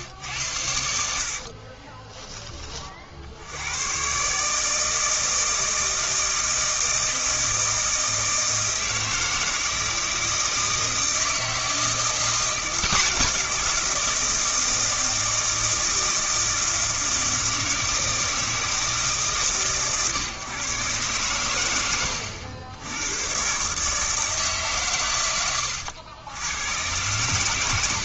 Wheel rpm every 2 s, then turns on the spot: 80, 30, 150, 160, 160, 160, 180, 170, 160, 160, 130, 90, 140, 110.
none